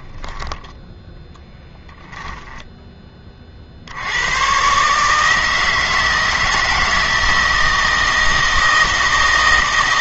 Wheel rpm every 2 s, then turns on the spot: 10, 10, 130, 160, 160.
none